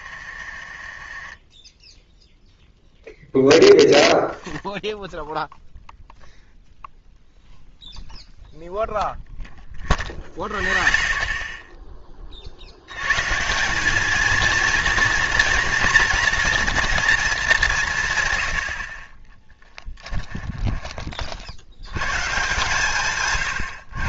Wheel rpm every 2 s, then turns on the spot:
40, 0, 0, 0, 0, 0, 80, 230, 230, 50, 20, 150.
0-2